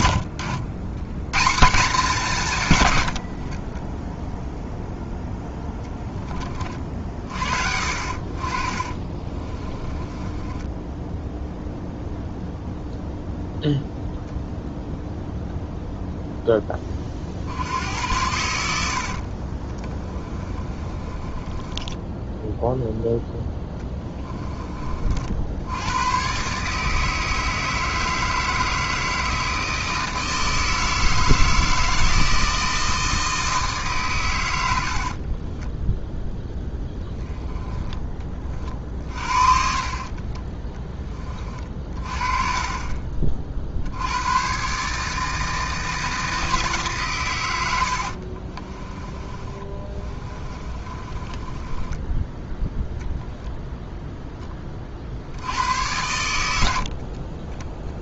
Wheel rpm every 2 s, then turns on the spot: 110, 140, 0, 30, 30, 10, 0, 0, 20, 70, 20, 0, 30, 150, 160, 160, 160, 80, 10, 40, 20, 30, 130, 150, 20, 30, 0, 20, 70.
8-12 18-22 48-52